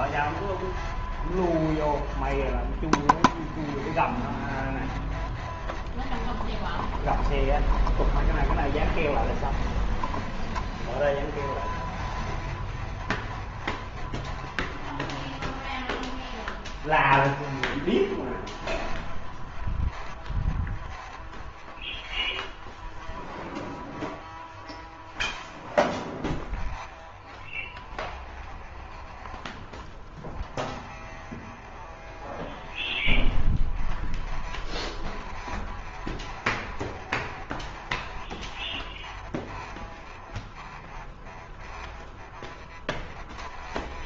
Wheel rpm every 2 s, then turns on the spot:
0, 0, 0, 0, 0, 0, 0, 0, 0, 0, 0, 0, 0, 0, 0, 0, 0, 0, 0, 0, 0, 0.
none